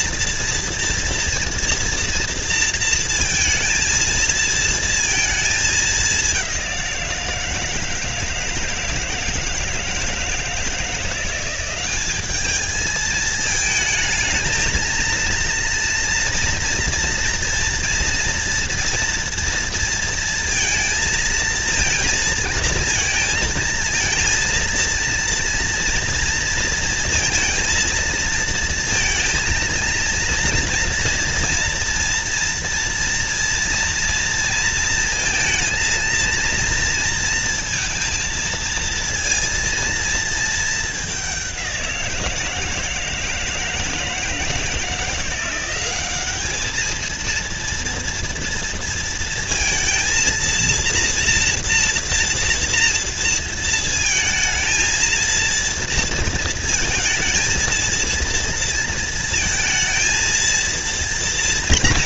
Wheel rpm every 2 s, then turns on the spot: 230, 230, 230, 190, 160, 160, 210, 220, 240, 230, 230, 230, 230, 230, 230, 230, 230, 230, 230, 230, 220, 160, 160, 210, 230, 230, 230, 230, 230, 230, 230.
none